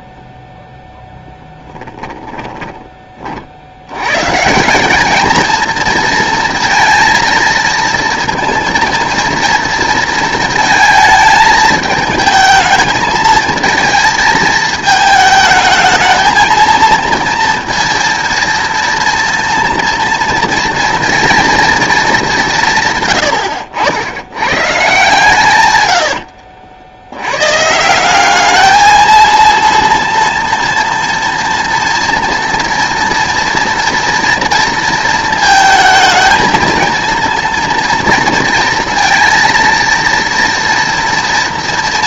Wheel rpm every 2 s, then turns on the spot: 0, 20, 190, 230, 230, 220, 220, 220, 220, 230, 230, 140, 140, 80, 220, 230, 240, 230, 230, 230, 230.
2-4